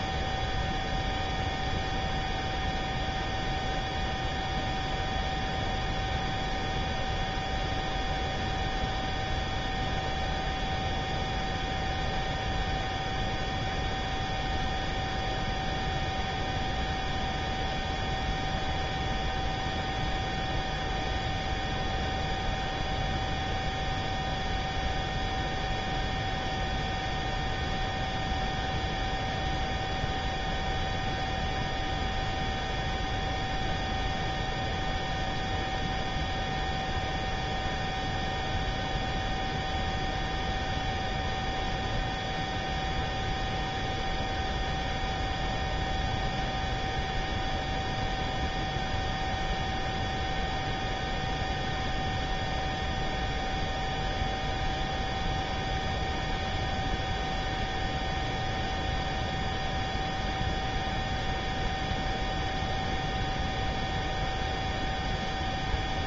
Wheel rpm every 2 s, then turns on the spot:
0, 0, 0, 0, 0, 0, 0, 0, 0, 0, 0, 0, 0, 0, 0, 0, 0, 0, 0, 0, 0, 0, 0, 0, 0, 0, 0, 0, 0, 0, 0, 0, 0.
none